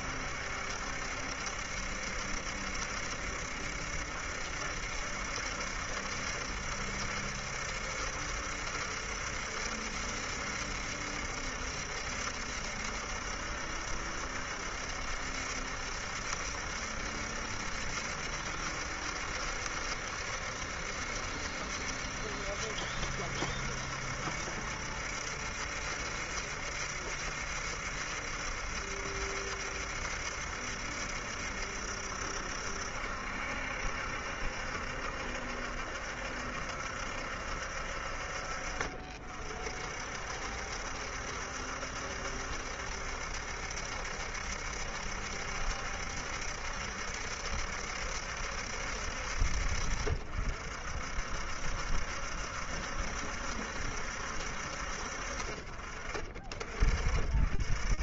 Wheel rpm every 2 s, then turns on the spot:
70, 70, 70, 70, 70, 70, 70, 70, 70, 70, 70, 70, 70, 70, 70, 70, 70, 70, 70, 50, 70, 70, 70, 70, 70, 60, 70, 50, 50.
none